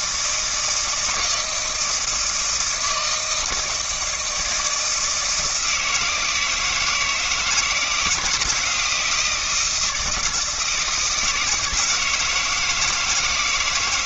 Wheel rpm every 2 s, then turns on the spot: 160, 160, 160, 160, 170, 160, 160.
none